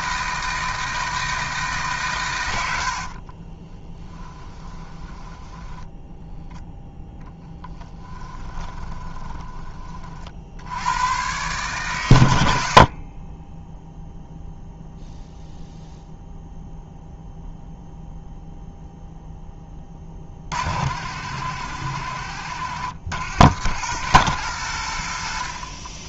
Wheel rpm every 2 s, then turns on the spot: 160, 80, 20, 0, 20, 90, 60, 0, 0, 0, 70, 90, 90.
2-6 8-10